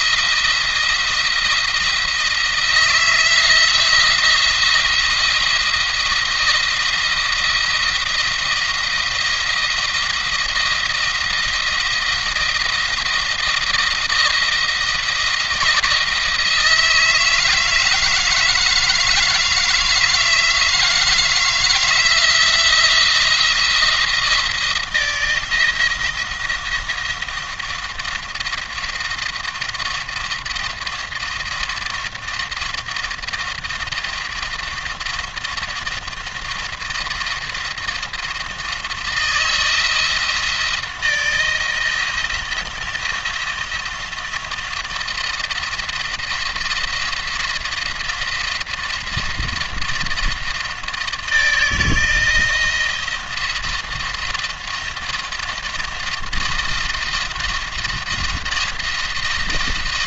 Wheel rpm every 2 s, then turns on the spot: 170, 170, 170, 170, 170, 170, 160, 170, 160, 160, 160, 170, 160, 170, 170, 170, 170, 170, 170, 170, 170, 170, 170, 170, 170, 160, 170, 170, 170, 170.
none